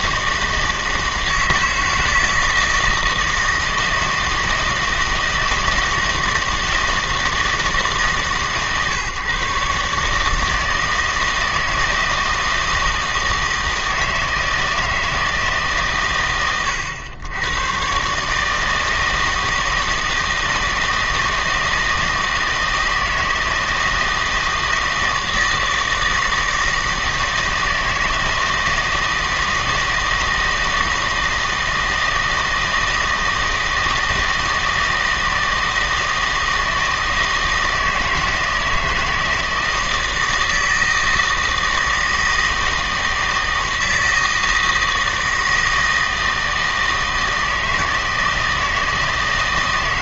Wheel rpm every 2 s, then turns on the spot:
160, 160, 160, 160, 140, 160, 160, 160, 100, 160, 160, 160, 160, 160, 160, 160, 160, 160, 160, 160, 160, 160, 160, 160, 160.
none